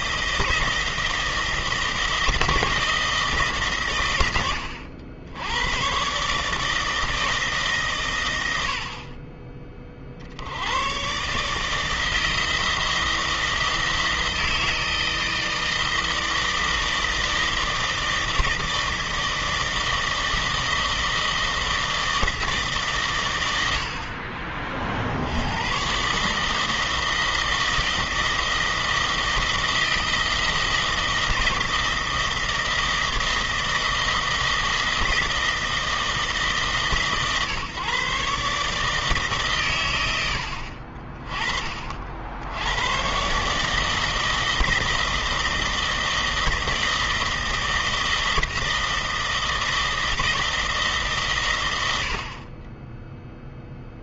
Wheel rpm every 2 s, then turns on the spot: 160, 160, 80, 160, 40, 120, 160, 160, 160, 160, 160, 120, 70, 160, 160, 160, 160, 160, 140, 150, 50, 110, 160, 160, 160, 140, 10.
none